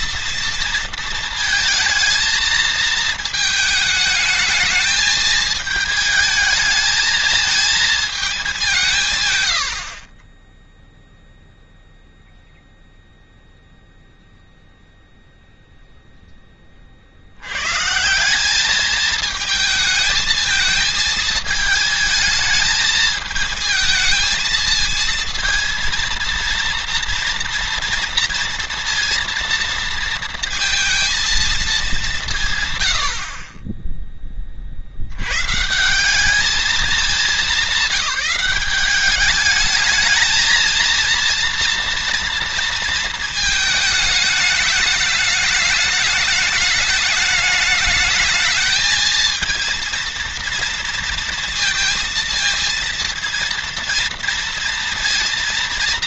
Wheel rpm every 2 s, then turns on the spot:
230, 220, 220, 220, 200, 10, 0, 0, 10, 190, 220, 220, 220, 230, 230, 230, 160, 30, 200, 190, 220, 230, 210, 210, 220, 230, 230, 230.
none